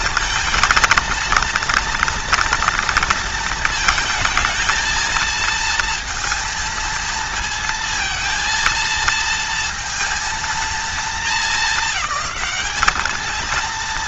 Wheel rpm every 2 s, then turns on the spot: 230, 230, 230, 230, 230, 220, 220.
none